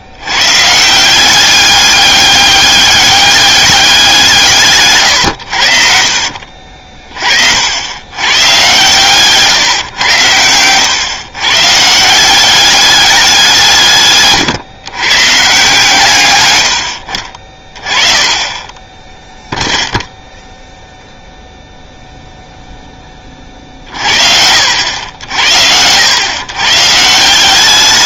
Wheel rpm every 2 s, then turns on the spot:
130, 200, 150, 40, 120, 110, 200, 130, 90, 20, 0, 0, 60, 120.
none